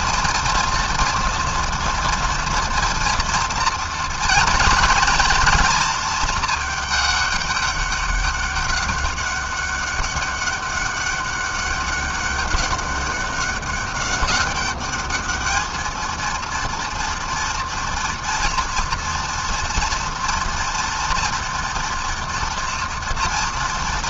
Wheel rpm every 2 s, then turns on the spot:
230, 230, 230, 210, 200, 200, 200, 210, 230, 230, 240, 230.
none